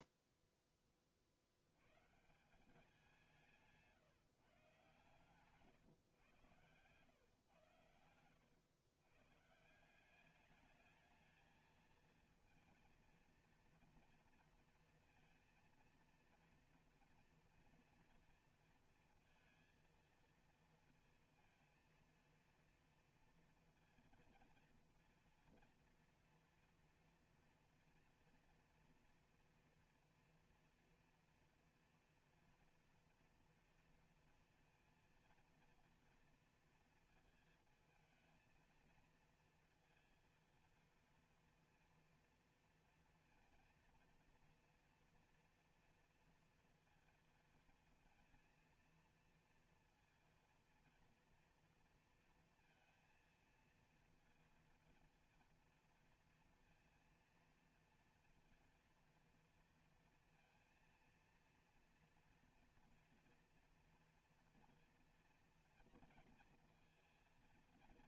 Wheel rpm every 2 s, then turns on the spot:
0, 160, 150, 120, 110, 200, 230, 230, 230, 230, 230, 230, 230, 230, 230, 240, 230, 240, 230, 230, 230, 230, 230, 230, 230, 230, 230, 230, 230, 230, 230, 240, 240, 230.
8-10